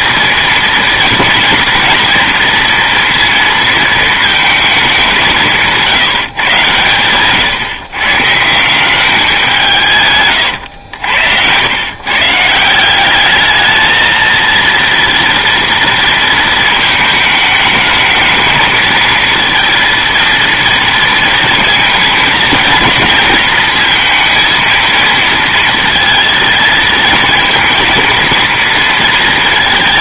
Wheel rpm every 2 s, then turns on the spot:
230, 230, 220, 120, 180, 100, 170, 230, 220, 220, 230, 230, 230, 220, 230.
none